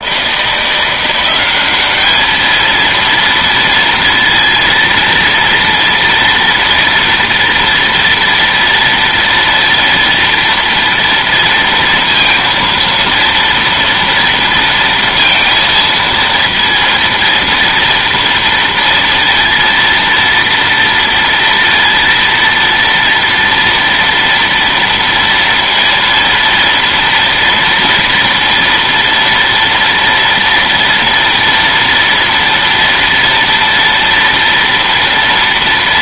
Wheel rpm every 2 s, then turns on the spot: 170, 220, 230, 230, 230, 230, 230, 230, 230, 230, 230, 230, 230, 230, 230, 230, 230, 230.
none